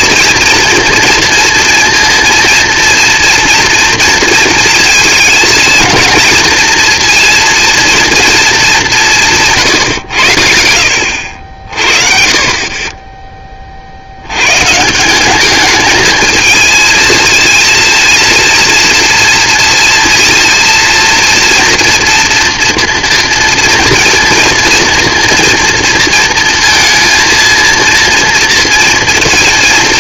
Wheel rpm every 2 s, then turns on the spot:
230, 230, 220, 230, 190, 70, 20, 180, 220, 230, 230, 230, 230, 230, 230.
12-14